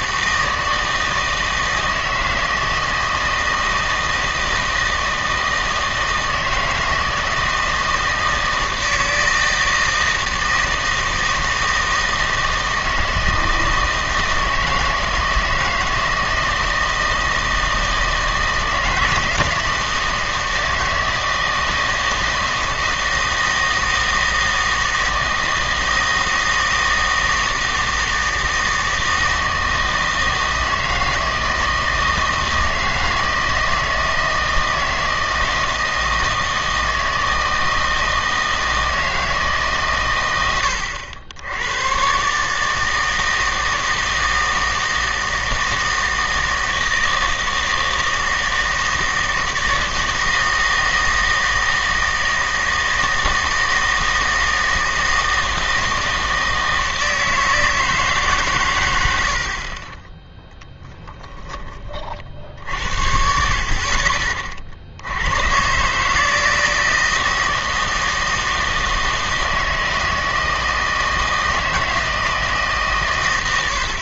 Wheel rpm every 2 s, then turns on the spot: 160, 160, 160, 160, 160, 160, 160, 160, 160, 160, 160, 160, 160, 160, 160, 160, 160, 160, 160, 160, 100, 150, 160, 160, 160, 160, 160, 160, 160, 120, 0, 60, 50, 160, 160, 160, 150.
none